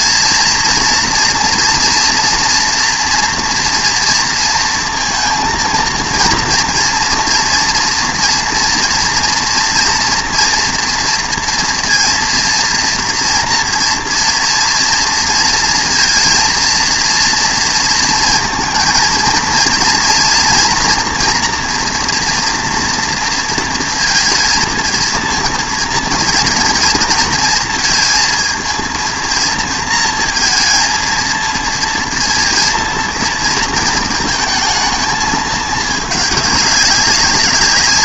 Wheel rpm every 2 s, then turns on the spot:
230, 240, 230, 230, 230, 240, 230, 230, 230, 230, 240, 240, 230, 240, 230, 230, 230, 230, 200.
none